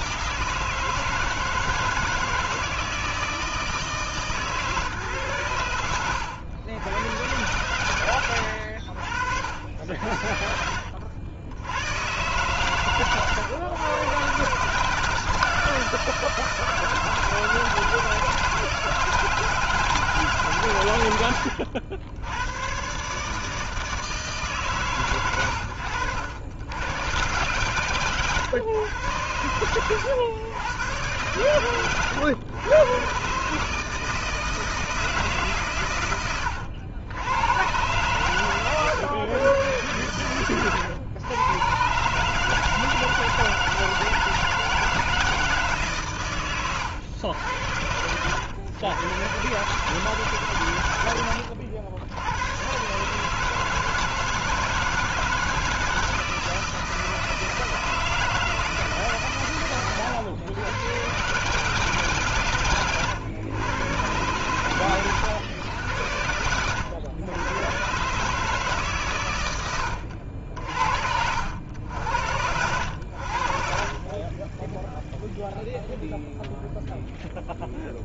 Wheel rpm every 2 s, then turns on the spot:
160, 160, 140, 90, 80, 60, 130, 140, 170, 160, 140, 120, 140, 100, 120, 110, 110, 160, 100, 120, 100, 160, 160, 110, 110, 130, 110, 160, 160, 160, 110, 120, 120, 90, 150, 70, 80, 10, 0.
10-12